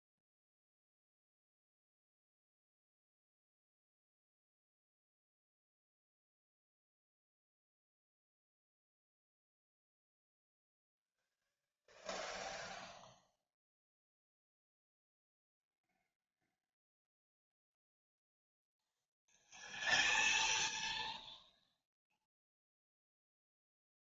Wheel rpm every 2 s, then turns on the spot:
0, 0, 0, 0, 0, 0, 0, 0, 0, 0, 0, 0.
none